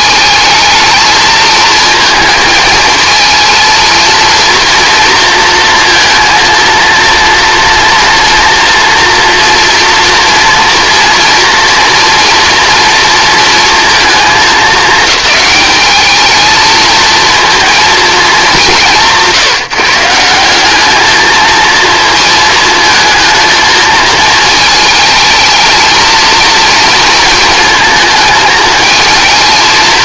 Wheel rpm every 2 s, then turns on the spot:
220, 230, 230, 230, 230, 230, 230, 210, 220, 190, 200, 220, 220, 230, 220.
none